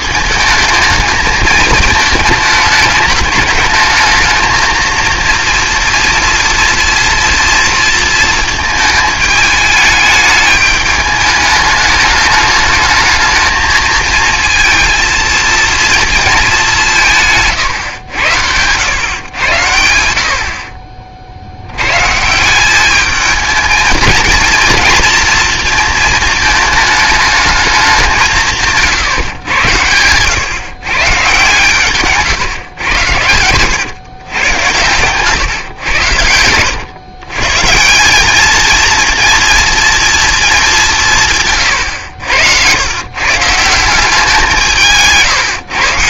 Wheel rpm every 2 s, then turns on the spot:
220, 210, 230, 230, 220, 210, 210, 230, 180, 100, 50, 210, 230, 220, 160, 130, 110, 110, 100, 230, 190, 120, 160.
none